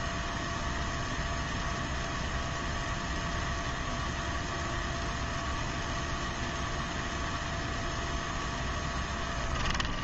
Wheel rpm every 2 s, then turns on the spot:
0, 0, 0, 0, 0.
none